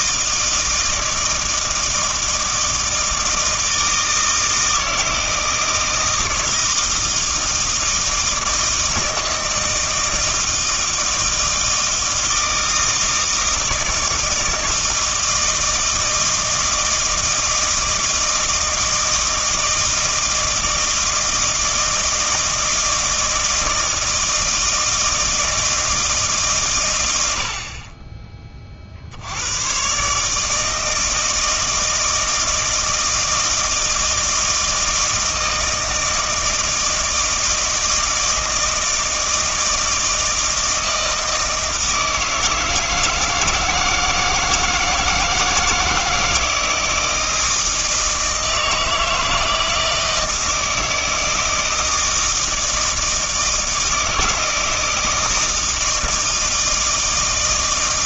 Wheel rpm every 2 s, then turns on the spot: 160, 160, 160, 160, 160, 160, 160, 160, 160, 160, 160, 160, 160, 130, 30, 160, 160, 160, 160, 160, 160, 160, 160, 160, 160, 160, 160, 160, 160.
none